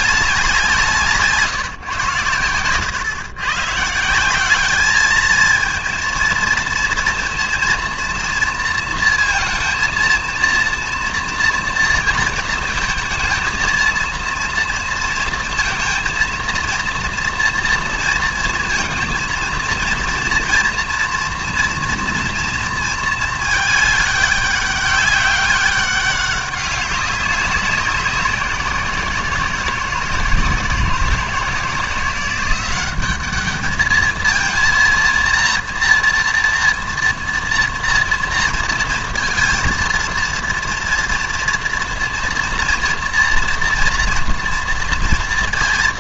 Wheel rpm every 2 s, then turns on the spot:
170, 120, 200, 230, 230, 230, 230, 230, 230, 230, 230, 230, 200, 190, 170, 160, 190, 230, 230, 230, 230, 230, 230.
none